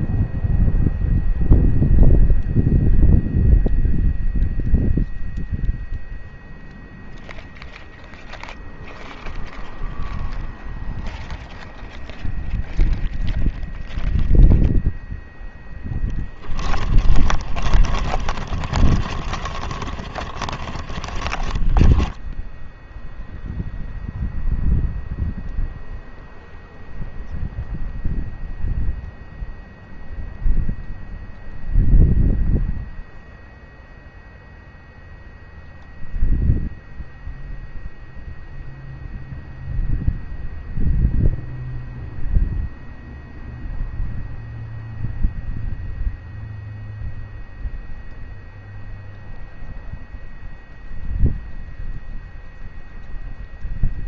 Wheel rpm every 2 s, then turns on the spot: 0, 0, 0, 0, 0, 0, 0, 0, 30, 40, 30, 10, 0, 0, 0, 0, 0, 0, 0, 0, 0, 0, 0, 0, 0, 0, 0.
16-22